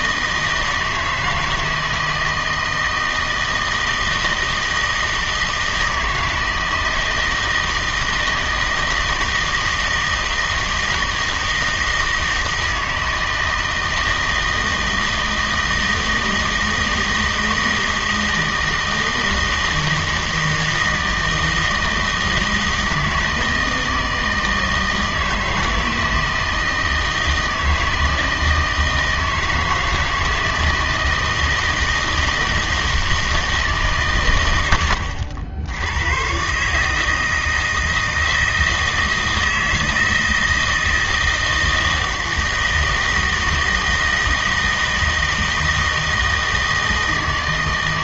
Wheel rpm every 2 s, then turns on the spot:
160, 160, 160, 160, 160, 160, 160, 160, 160, 160, 160, 160, 160, 160, 160, 160, 160, 90, 130, 160, 160, 160, 160, 160.
none